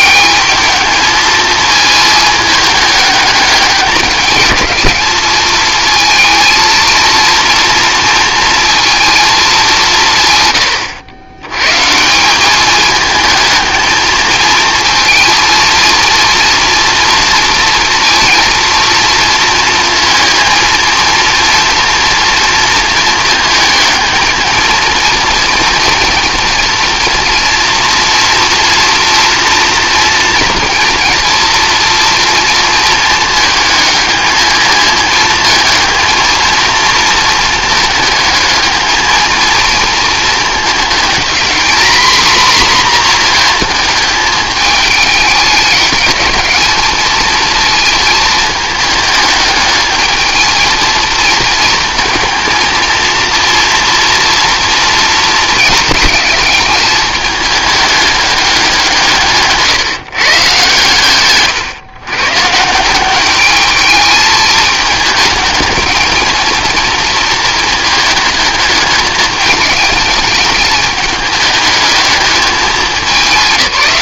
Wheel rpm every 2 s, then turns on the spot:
220, 210, 210, 220, 230, 110, 210, 230, 240, 230, 230, 230, 230, 230, 230, 230, 230, 220, 230, 220, 220, 240, 210, 220, 220, 220, 230, 230, 210, 190, 130, 160, 210, 220, 210, 210, 210.
none